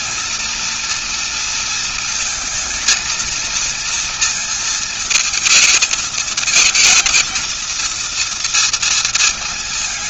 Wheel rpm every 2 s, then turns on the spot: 230, 220, 230, 220, 230.
none